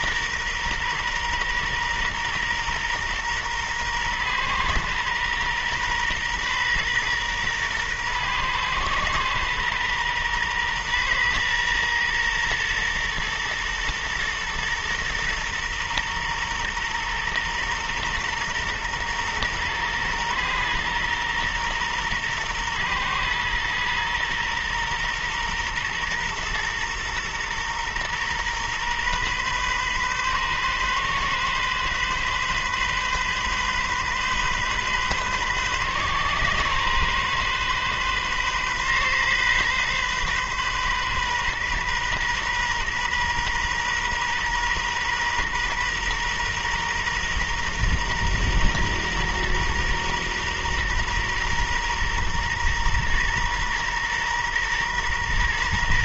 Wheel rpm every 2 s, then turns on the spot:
120, 120, 120, 120, 120, 120, 120, 120, 120, 120, 120, 120, 120, 120, 120, 130, 130, 130, 130, 130, 130, 130, 120, 120, 120, 120, 120, 120.
none